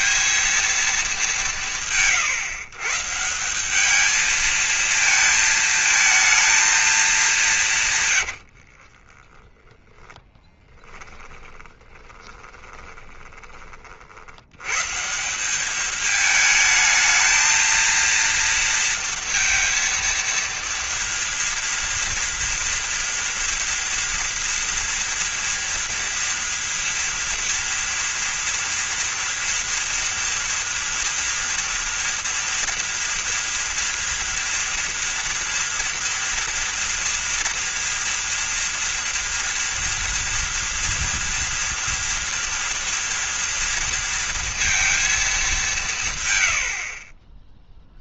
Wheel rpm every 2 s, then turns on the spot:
220, 150, 220, 210, 40, 20, 30, 150, 220, 230, 230, 230, 230, 230, 240, 240, 230, 230, 230, 230, 230, 230, 230, 60.
8-14